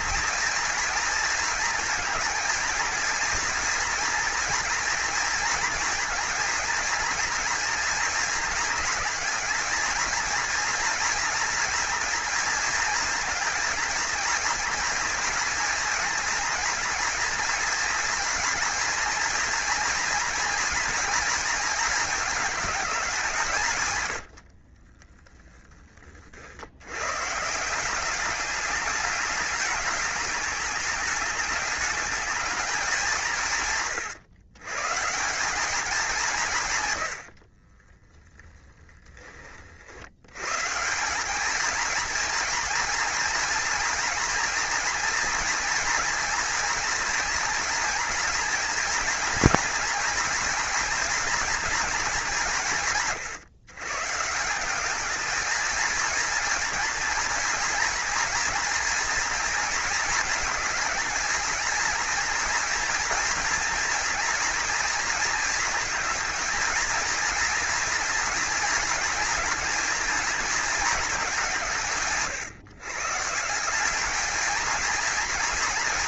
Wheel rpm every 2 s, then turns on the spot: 230, 230, 230, 230, 230, 230, 230, 230, 230, 230, 230, 200, 30, 90, 210, 210, 200, 150, 120, 10, 160, 230, 230, 230, 230, 230, 160, 190, 230, 230, 230, 230, 230, 230, 230, 210, 130, 230.
24-26